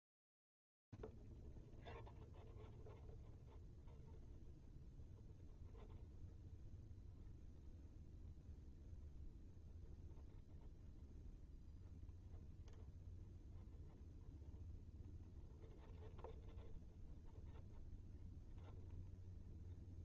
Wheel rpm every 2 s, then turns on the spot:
0, 0, 0, 0, 0, 0, 0, 0, 0, 0.
none